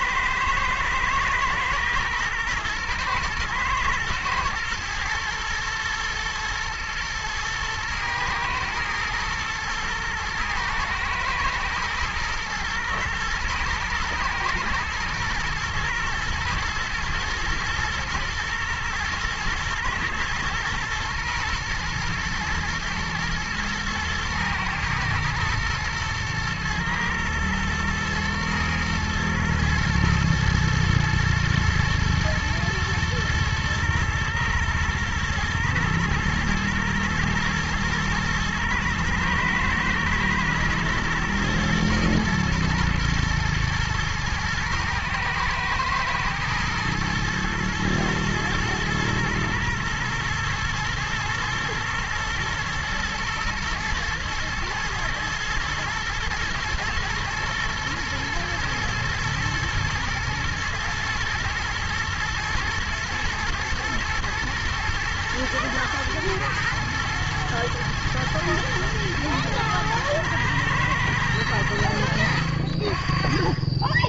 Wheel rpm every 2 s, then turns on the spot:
110, 120, 120, 120, 120, 120, 120, 110, 120, 110, 120, 110, 110, 110, 110, 110, 120, 110, 120, 120, 120, 120, 110, 110, 110, 110, 120, 120, 120, 120, 110, 110, 110, 110, 120, 110, 80.
none